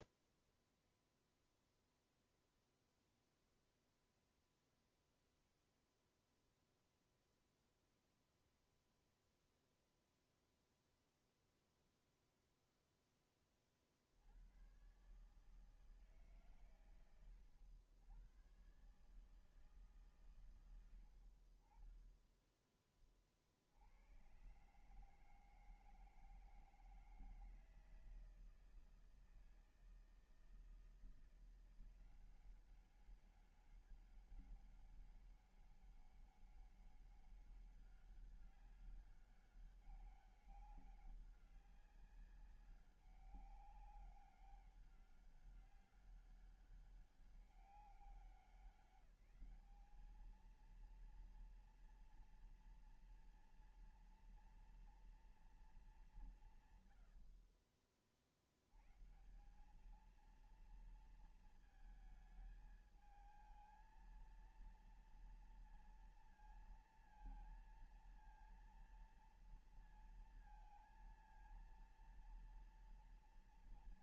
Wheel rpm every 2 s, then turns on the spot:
0, 0, 0, 0, 0, 0, 0, 60, 150, 100, 130, 20, 110, 160, 160, 160, 180, 200, 200, 200, 200, 190, 200, 200, 180, 210, 230, 230, 180, 40, 210, 220, 230, 230, 230, 230, 230.
none